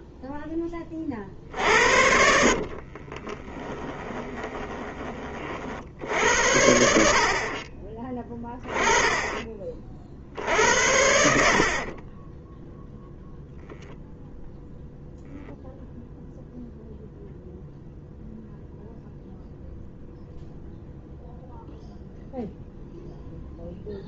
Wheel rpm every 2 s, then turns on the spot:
10, 70, 20, 80, 20, 70, 10, 0, 0, 0, 0, 0.
2-6